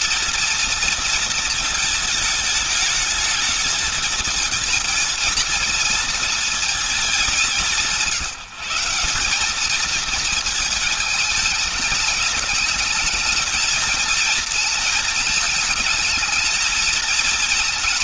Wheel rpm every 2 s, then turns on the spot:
230, 210, 220, 230, 170, 220, 220, 230, 230.
none